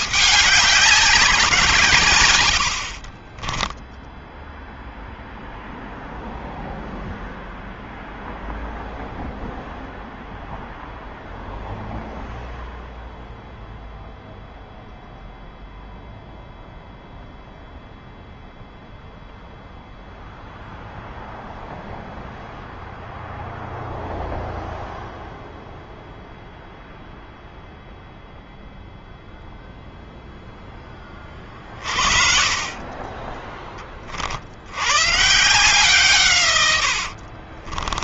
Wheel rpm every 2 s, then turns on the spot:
200, 90, 0, 0, 0, 0, 0, 0, 0, 0, 0, 0, 0, 0, 0, 0, 40, 60, 130.
2-4 36-38